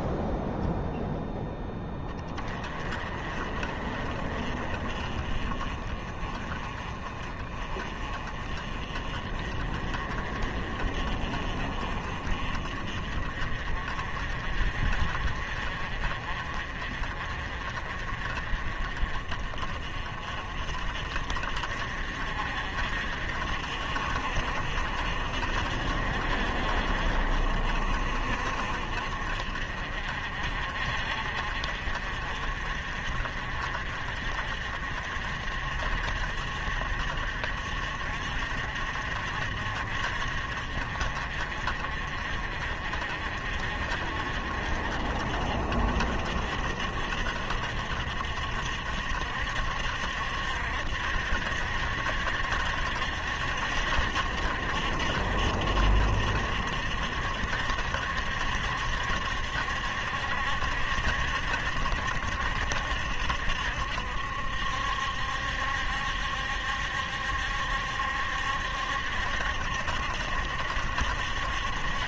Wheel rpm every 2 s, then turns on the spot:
0, 30, 40, 30, 40, 40, 40, 50, 40, 40, 50, 50, 60, 50, 50, 50, 50, 50, 50, 60, 50, 50, 50, 60, 60, 60, 70, 60, 60, 70, 70, 70, 70, 70, 70, 70.
none